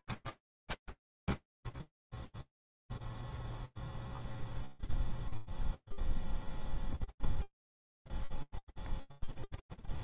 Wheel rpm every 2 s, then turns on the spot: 10, 0, 0, 0, 0.
0-2